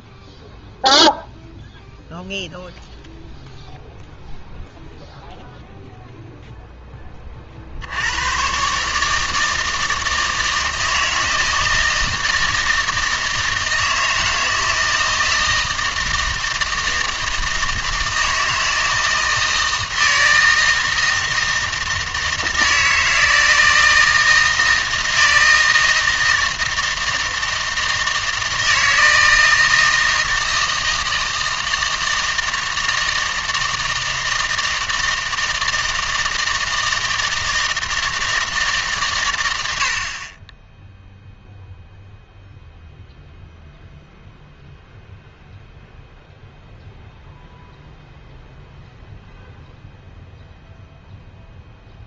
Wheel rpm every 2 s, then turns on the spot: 0, 0, 0, 0, 130, 160, 160, 160, 160, 160, 160, 160, 160, 160, 160, 160, 160, 160, 160, 150, 10, 0, 0, 0, 0, 0.
none